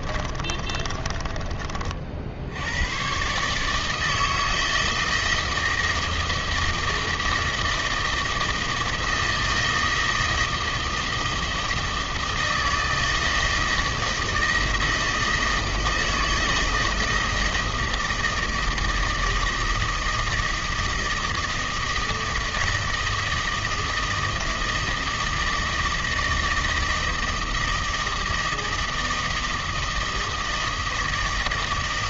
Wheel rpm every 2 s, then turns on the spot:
40, 90, 160, 160, 160, 160, 160, 160, 160, 160, 160, 160, 160, 160, 160, 160.
0-2